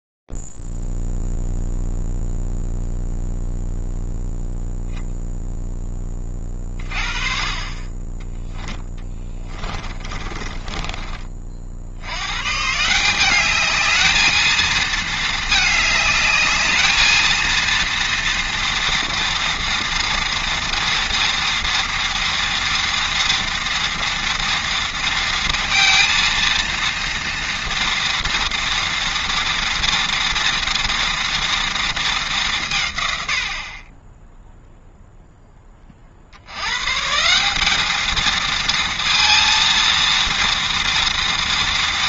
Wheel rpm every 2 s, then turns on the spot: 0, 0, 0, 20, 10, 20, 140, 220, 210, 230, 230, 230, 230, 230, 230, 230, 150, 0, 140, 230, 230.
10-12